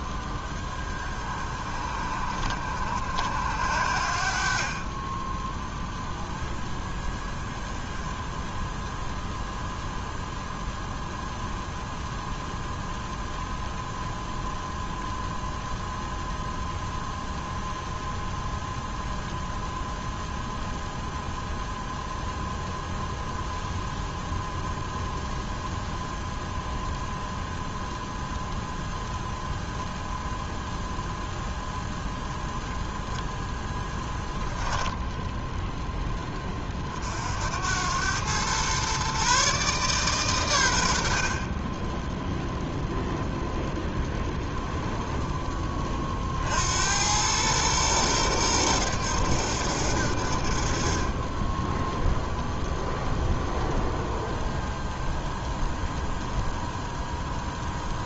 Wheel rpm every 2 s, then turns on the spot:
20, 60, 20, 10, 0, 0, 0, 0, 0, 0, 0, 0, 0, 0, 0, 0, 0, 10, 50, 130, 80, 0, 10, 90, 100, 40, 0, 0, 10.
none